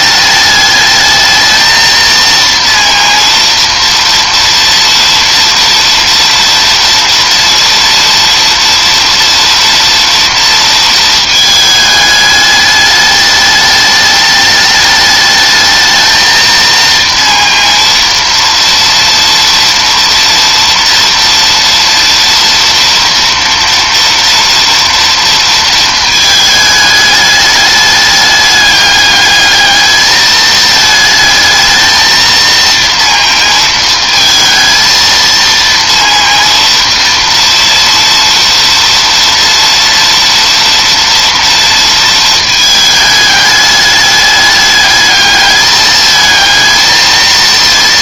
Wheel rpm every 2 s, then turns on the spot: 210, 230, 240, 230, 230, 230, 210, 210, 230, 230, 230, 240, 230, 210, 210, 220, 230, 230, 230, 230, 230, 220, 210, 220.
none